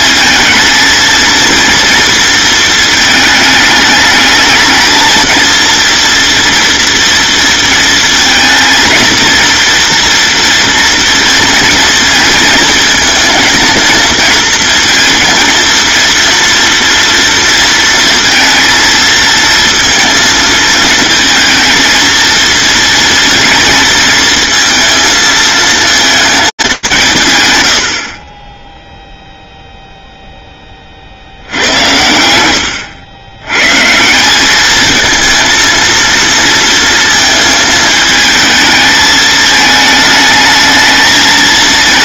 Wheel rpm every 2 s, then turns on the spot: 230, 220, 220, 230, 230, 240, 220, 230, 230, 230, 230, 230, 220, 160, 0, 40, 100, 220, 220, 220, 220.
none